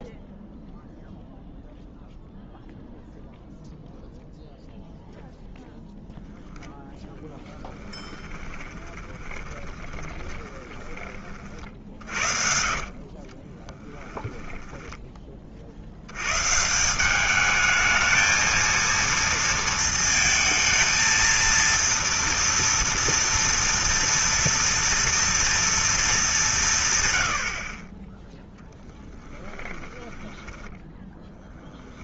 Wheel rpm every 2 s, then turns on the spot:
0, 0, 0, 0, 20, 30, 60, 10, 120, 220, 220, 230, 230, 180, 10, 10.
8-16 28-32